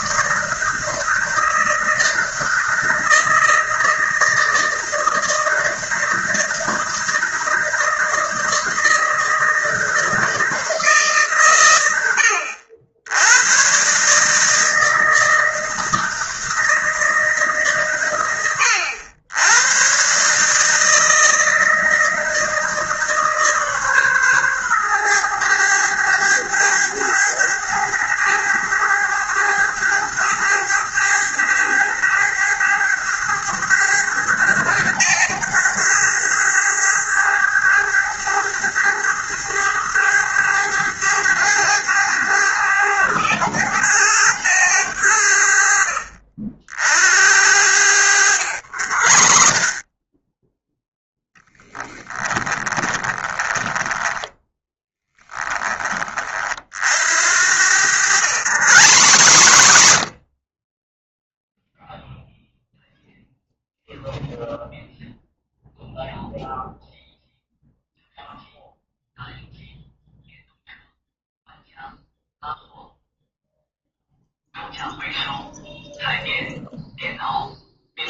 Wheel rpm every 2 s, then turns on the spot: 160, 160, 160, 160, 160, 140, 120, 160, 150, 110, 160, 150, 110, 100, 100, 100, 100, 100, 100, 100, 100, 100, 70, 70, 70, 20, 30, 10, 70, 160, 30, 0, 0, 0, 0, 0, 0, 0, 0.
48-50 52-54 56-62